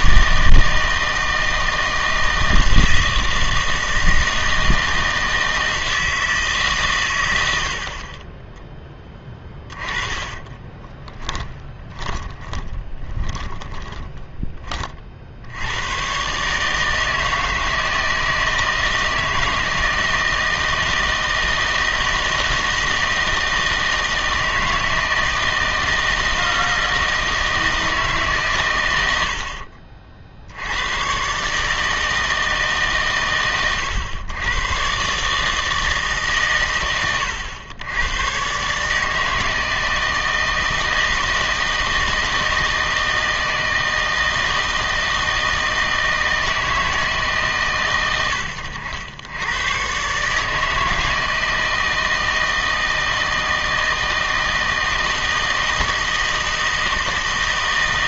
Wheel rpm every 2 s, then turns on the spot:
160, 160, 160, 150, 10, 20, 20, 20, 150, 160, 160, 160, 160, 160, 120, 80, 150, 110, 130, 130, 160, 160, 160, 160, 90, 160, 160, 160, 160.
10-14